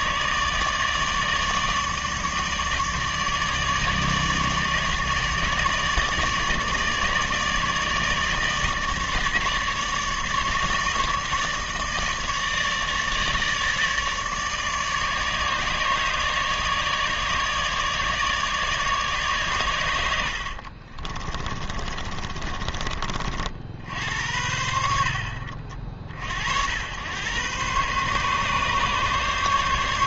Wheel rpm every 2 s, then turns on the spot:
150, 150, 150, 150, 150, 150, 160, 150, 150, 150, 50, 30, 60, 90, 140.
20-22